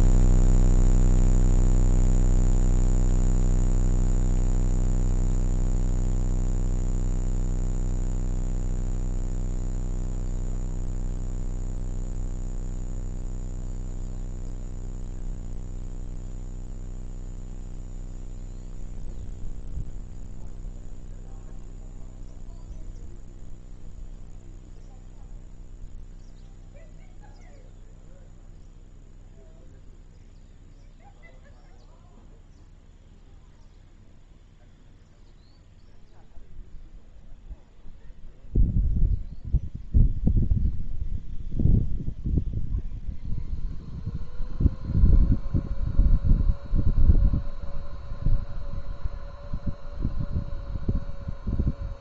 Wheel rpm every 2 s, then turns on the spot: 0, 0, 0, 0, 0, 0, 0, 0, 0, 0, 0, 0, 0, 0, 0, 0, 0, 0, 0, 0, 0, 0, 0, 0, 0, 0.
none